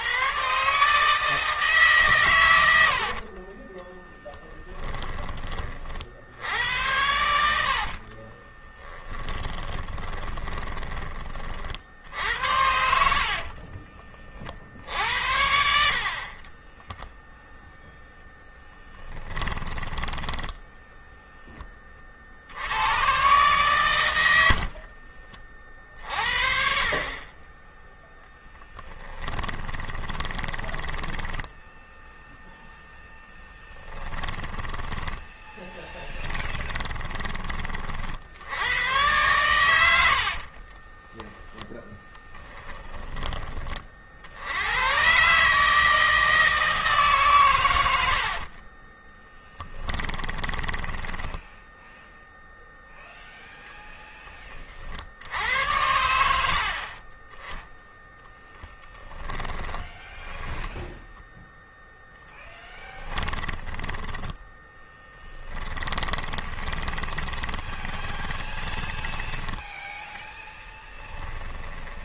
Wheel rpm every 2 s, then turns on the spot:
150, 60, 20, 90, 20, 20, 60, 60, 10, 10, 0, 100, 50, 40, 10, 10, 0, 20, 10, 100, 20, 20, 110, 140, 20, 10, 0, 60, 50, 20, 0, 10, 10, 20, 10, 10.
2-4 8-10 12-14 16-20 24-26 28-32 34-36 40-42 50-52 58-60 62-70